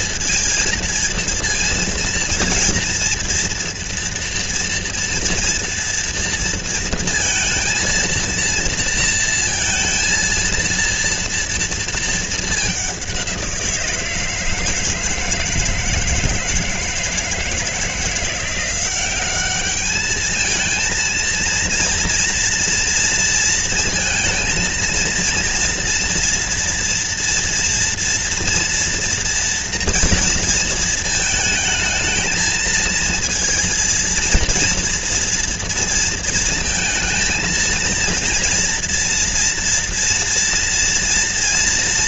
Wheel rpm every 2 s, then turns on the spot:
230, 240, 230, 230, 230, 230, 180, 160, 160, 190, 220, 230, 230, 230, 230, 220, 230, 230, 230, 230, 230.
none